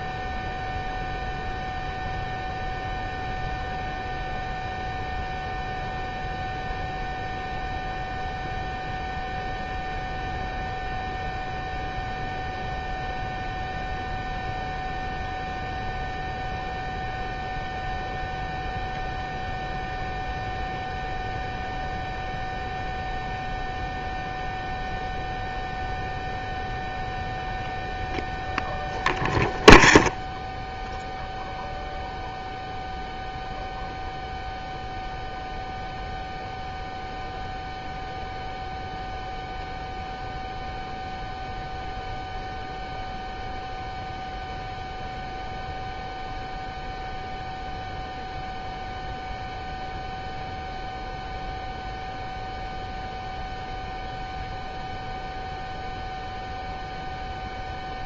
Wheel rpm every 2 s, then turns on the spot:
0, 0, 0, 0, 0, 0, 0, 0, 0, 0, 0, 0, 0, 0, 0, 0, 0, 0, 0, 0, 0, 0, 0, 0, 0, 0, 0, 0, 0.
none